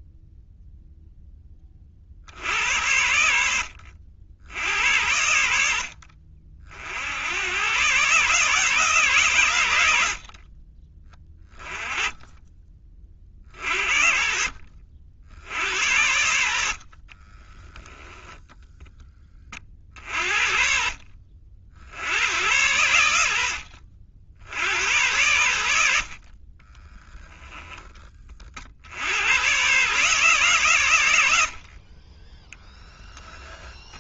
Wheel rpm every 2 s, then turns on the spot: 0, 80, 80, 80, 140, 20, 40, 60, 40, 10, 50, 90, 90, 10, 90, 110, 10.
16-18 26-28 32-34